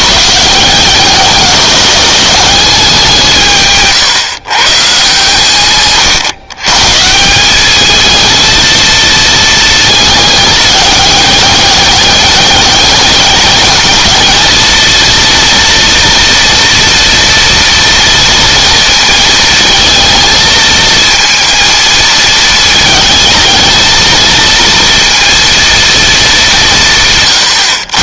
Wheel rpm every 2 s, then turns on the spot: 170, 200, 130, 130, 220, 210, 200, 220, 230, 230, 230, 220, 230, 170.
none